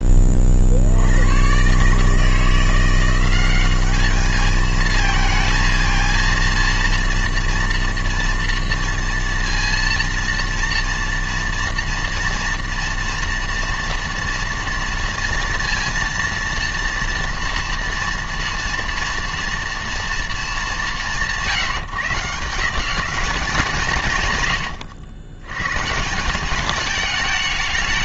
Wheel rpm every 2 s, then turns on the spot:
50, 170, 220, 230, 230, 230, 230, 230, 230, 230, 210, 160, 120, 200.
none